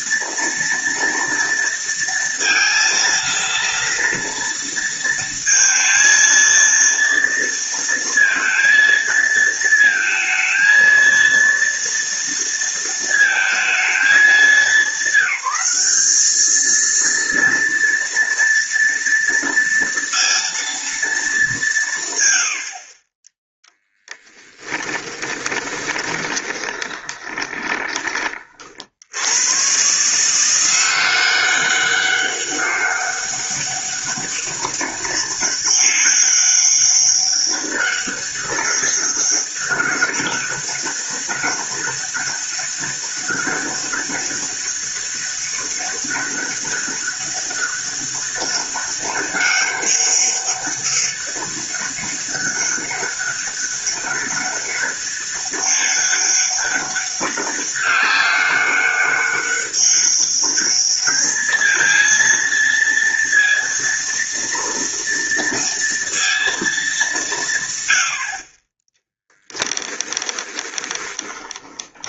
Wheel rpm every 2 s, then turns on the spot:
230, 230, 230, 230, 230, 230, 230, 200, 220, 230, 230, 30, 20, 20, 50, 180, 200, 200, 200, 200, 200, 200, 200, 200, 200, 200, 200, 200, 200, 200, 210, 230, 230, 220, 20, 20.
24-28 70-72